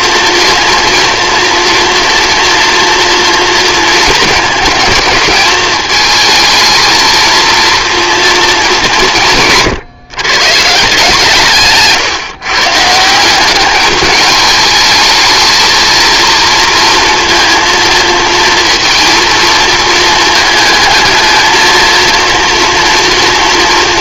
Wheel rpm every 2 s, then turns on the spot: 240, 240, 220, 220, 220, 150, 140, 220, 230, 230, 220, 230.
none